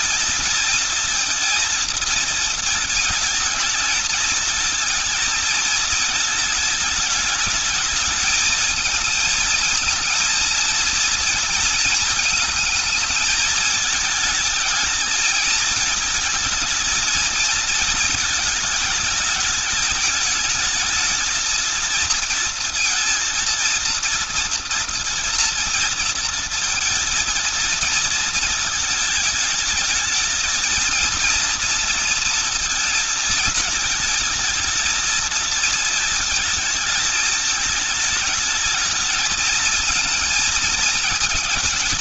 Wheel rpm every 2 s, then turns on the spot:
230, 220, 220, 210, 220, 230, 220, 220, 230, 210, 220, 230, 230, 230, 220, 230, 220, 220, 220, 220, 220.
none